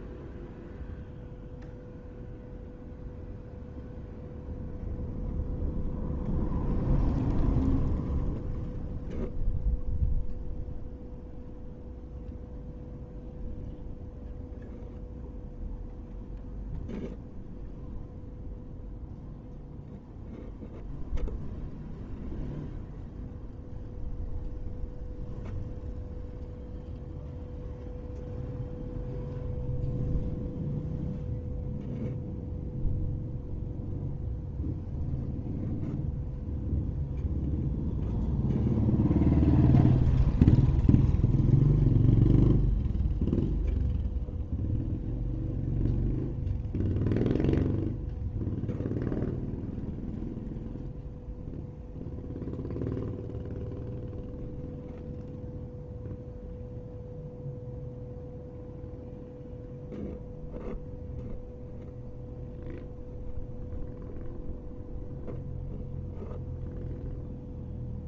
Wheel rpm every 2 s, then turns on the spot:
0, 0, 0, 0, 0, 0, 0, 0, 0, 0, 0, 0, 0, 0, 0, 0, 0, 0, 0, 0, 0, 0, 0, 0, 0, 0, 0, 0, 0, 0, 0, 0, 0, 0.
none